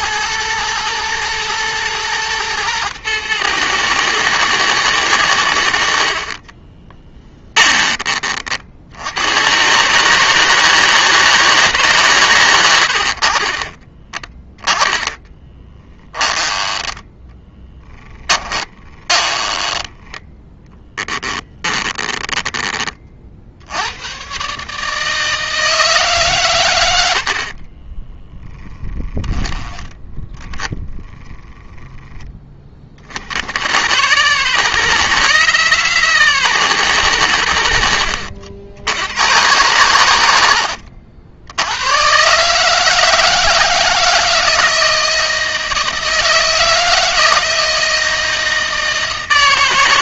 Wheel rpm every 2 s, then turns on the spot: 110, 110, 110, 20, 60, 160, 70, 20, 10, 20, 10, 30, 150, 80, 10, 10, 40, 150, 120, 80, 70, 160, 160, 160, 160.
6-8 14-22 28-30